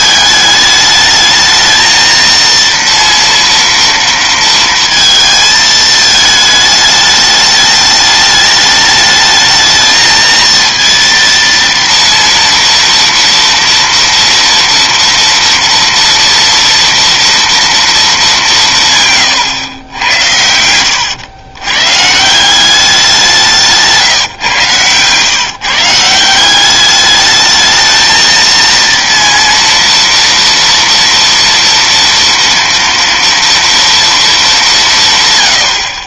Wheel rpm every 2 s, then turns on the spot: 210, 230, 230, 210, 210, 230, 230, 230, 230, 160, 100, 180, 130, 190, 230, 230, 230, 200.
20-22